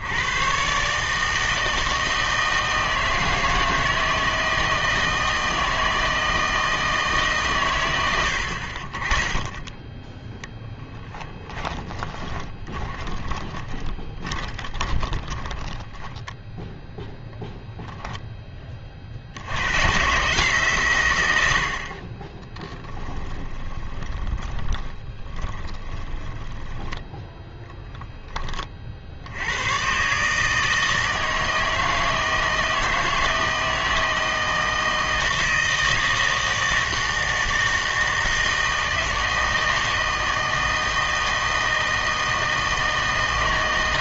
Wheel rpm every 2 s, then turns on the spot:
120, 160, 160, 160, 60, 10, 20, 20, 0, 20, 140, 20, 20, 10, 30, 150, 160, 160, 160, 160, 160, 160.
12-16 22-28